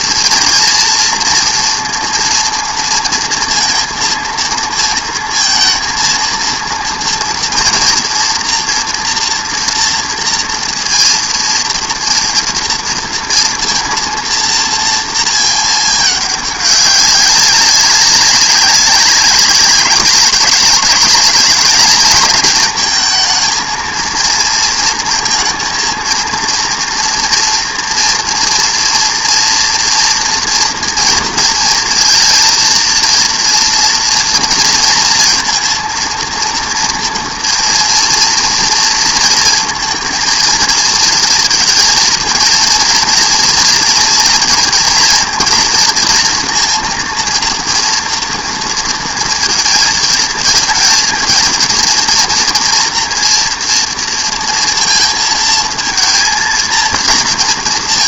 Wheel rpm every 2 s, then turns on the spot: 230, 230, 230, 230, 240, 230, 230, 230, 200, 190, 190, 220, 230, 240, 230, 230, 230, 230, 230, 230, 230, 230, 240, 230, 230, 230, 230, 230, 230.
none